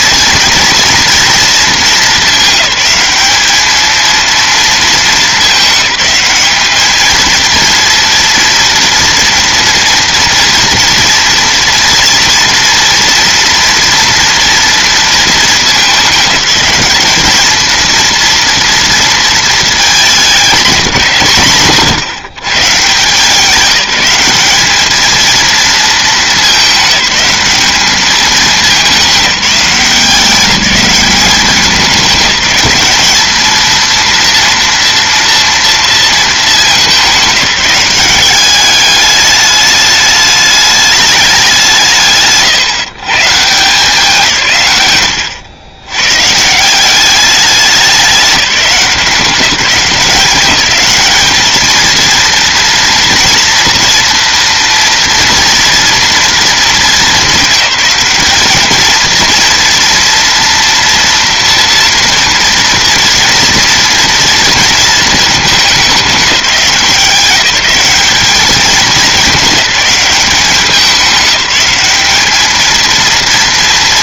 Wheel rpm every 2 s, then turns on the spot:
230, 210, 220, 210, 230, 240, 230, 230, 210, 230, 200, 140, 210, 210, 200, 200, 200, 230, 200, 210, 210, 140, 120, 180, 180, 200, 230, 230, 220, 220, 230, 230, 230, 190, 210, 200, 220.
none